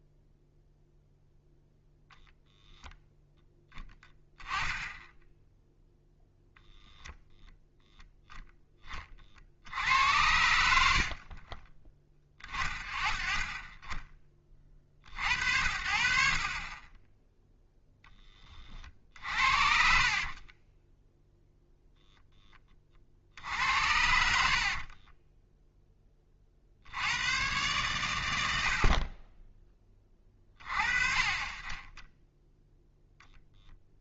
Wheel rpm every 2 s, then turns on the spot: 0, 0, 10, 0, 10, 80, 30, 50, 30, 40, 20, 30, 50, 60, 70, 40, 10.
4-6 10-12 20-22 24-26